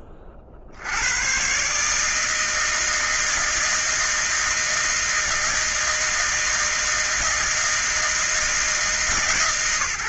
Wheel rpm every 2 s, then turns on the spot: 20, 160, 160, 160, 160.
none